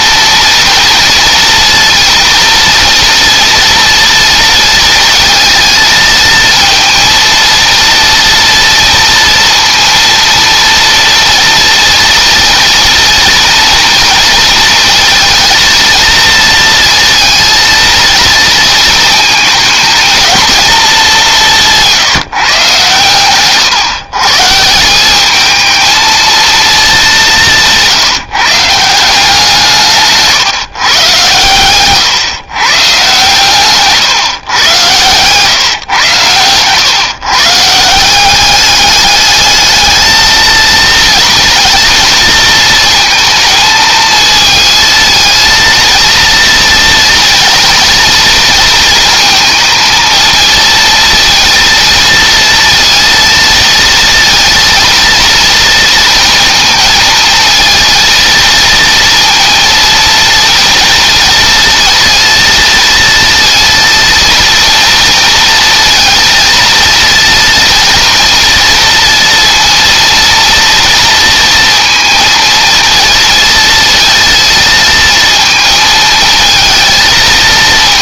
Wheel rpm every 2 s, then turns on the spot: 230, 230, 230, 230, 230, 230, 230, 230, 230, 230, 210, 130, 190, 200, 170, 130, 130, 120, 130, 210, 230, 230, 220, 230, 230, 230, 230, 230, 220, 230, 230, 230, 230, 230, 230, 230, 230, 230, 220.
22-24